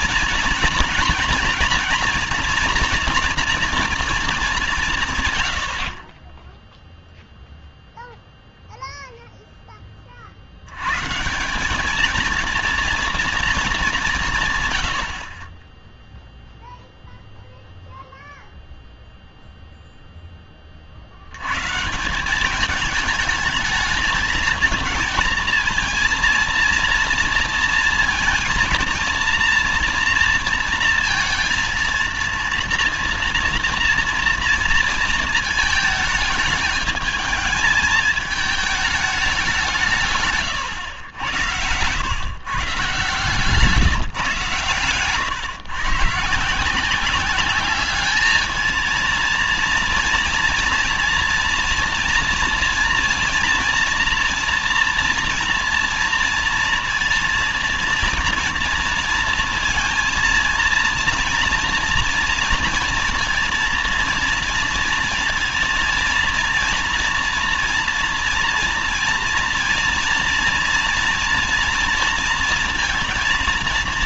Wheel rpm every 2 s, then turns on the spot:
230, 230, 200, 10, 0, 70, 230, 140, 0, 0, 20, 190, 220, 230, 230, 230, 230, 230, 220, 220, 130, 140, 150, 160, 220, 240, 230, 230, 230, 230, 230, 230, 230, 230, 240, 230, 230.
none